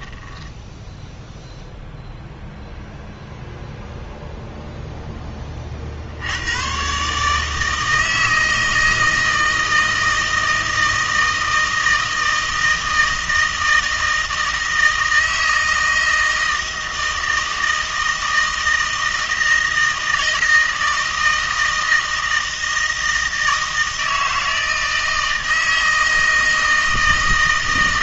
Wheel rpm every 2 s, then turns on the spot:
10, 0, 0, 120, 160, 160, 160, 160, 160, 160, 160, 160, 160, 160.
none